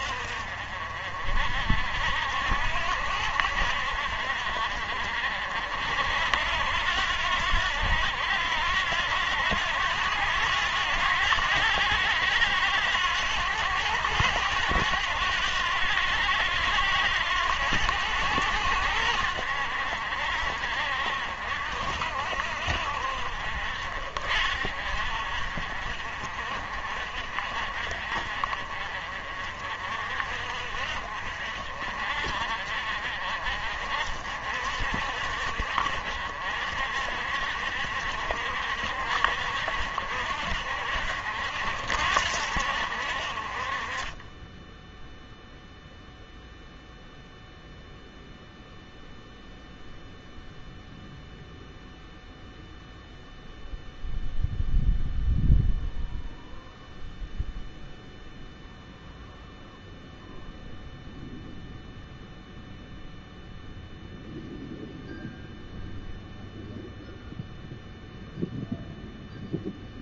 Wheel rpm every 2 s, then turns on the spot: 50, 70, 50, 80, 80, 90, 90, 100, 90, 80, 60, 60, 50, 50, 40, 50, 50, 60, 60, 60, 60, 60, 10, 0, 0, 0, 0, 0, 0, 0, 0, 0, 0, 0, 0.
none